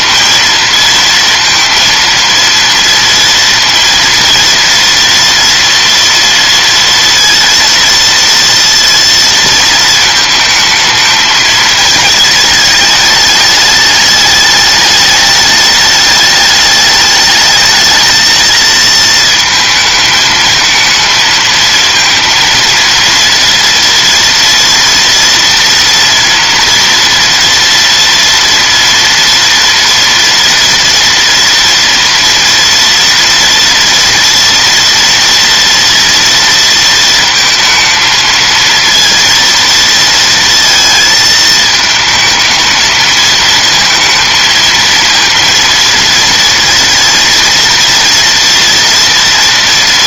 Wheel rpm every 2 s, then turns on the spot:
230, 230, 240, 230, 230, 220, 220, 210, 210, 220, 220, 230, 230, 230, 230, 230, 240, 230, 230, 230, 220, 220, 230, 230, 230.
none